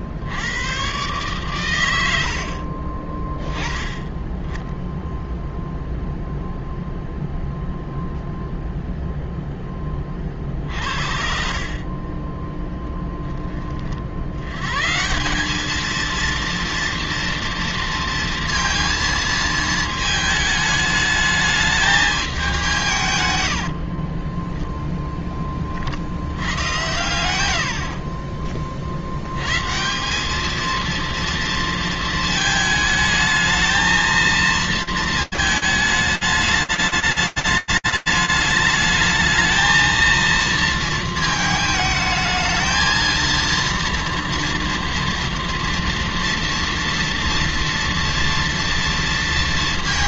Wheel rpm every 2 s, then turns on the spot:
70, 70, 10, 0, 0, 40, 30, 80, 230, 230, 220, 200, 0, 70, 40, 200, 220, 220, 220, 210, 220, 220, 230, 240, 230.
2-4